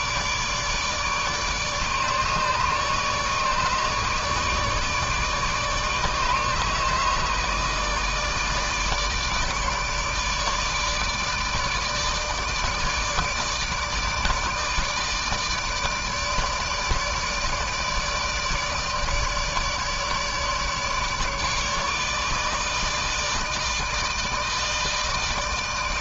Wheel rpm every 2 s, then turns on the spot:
150, 150, 150, 160, 150, 150, 150, 160, 160, 150, 150, 160, 160.
none